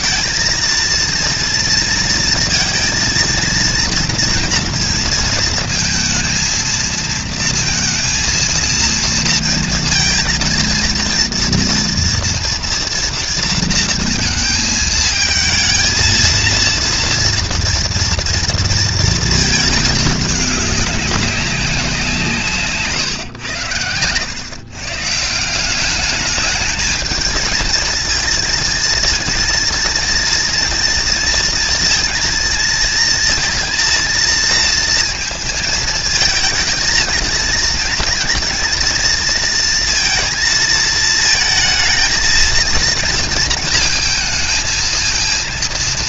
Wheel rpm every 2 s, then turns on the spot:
230, 230, 230, 230, 230, 230, 230, 220, 230, 230, 200, 140, 140, 220, 230, 230, 230, 230, 230, 230, 220, 230, 230.
none